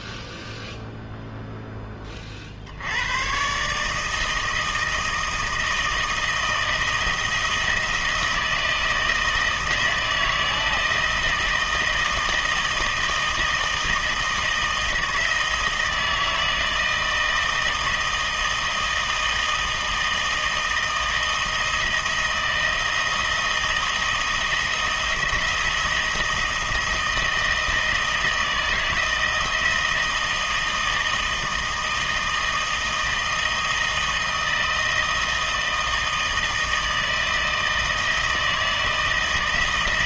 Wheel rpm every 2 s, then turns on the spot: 0, 50, 160, 160, 160, 160, 160, 160, 160, 160, 160, 160, 160, 160, 160, 160, 160, 160, 160, 160.
none